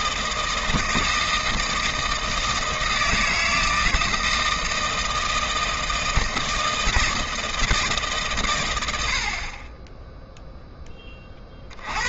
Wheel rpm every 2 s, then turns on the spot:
160, 160, 160, 170, 110, 10.
none